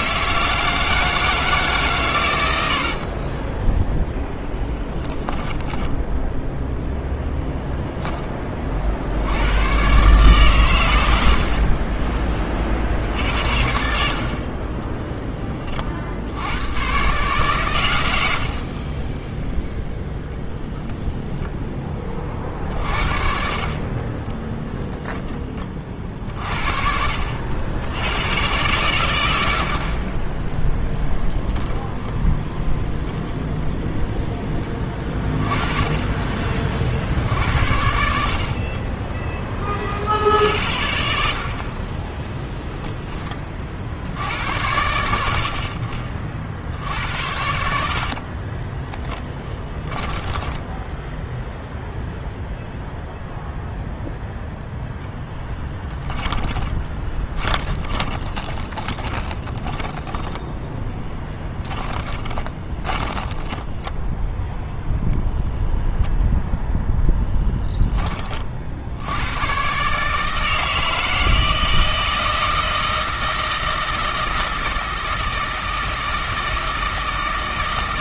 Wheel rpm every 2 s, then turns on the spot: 160, 70, 10, 10, 50, 110, 50, 20, 110, 40, 0, 40, 10, 50, 110, 0, 0, 20, 50, 20, 70, 10, 90, 70, 10, 10, 0, 0, 20, 20, 10, 20, 0, 0, 70, 160, 160, 160, 160.
2-6 18-20 48-52 56-64